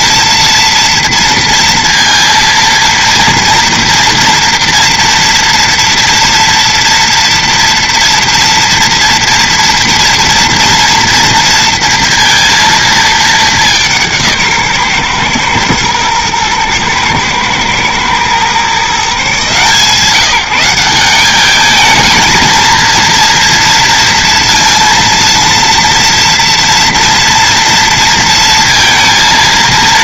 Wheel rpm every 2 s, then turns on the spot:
230, 230, 230, 230, 230, 230, 230, 140, 110, 140, 170, 230, 230, 230, 230.
none